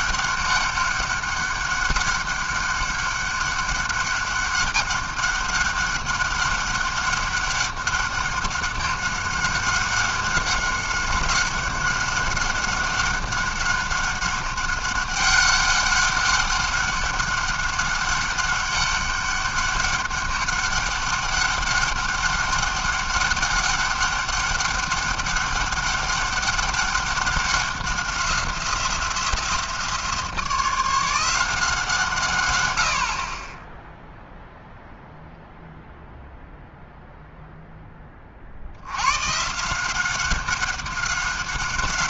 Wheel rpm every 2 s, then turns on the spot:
200, 200, 200, 200, 200, 190, 190, 190, 200, 200, 200, 200, 200, 190, 180, 170, 120, 0, 0, 50, 190.
none